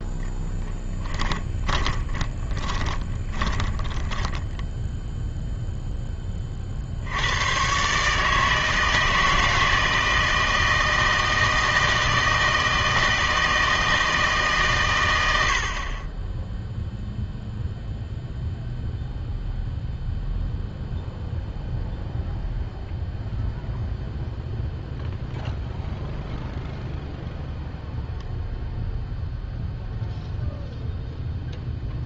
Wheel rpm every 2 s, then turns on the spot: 10, 20, 20, 30, 160, 160, 160, 150, 10, 0, 0, 0, 0, 0, 0, 0.
2-6